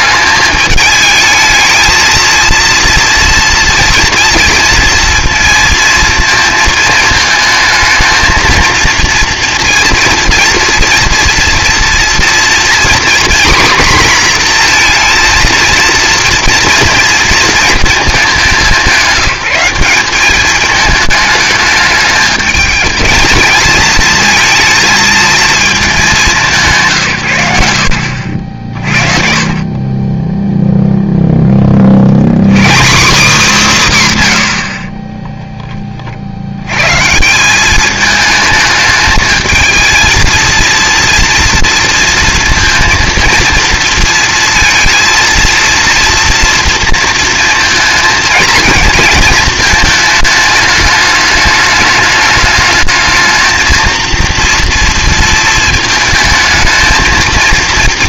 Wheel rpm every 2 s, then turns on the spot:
220, 230, 230, 230, 230, 230, 250, 240, 230, 200, 210, 220, 220, 170, 50, 0, 190, 60, 90, 220, 230, 230, 230, 230, 230, 210, 210, 230, 220.
none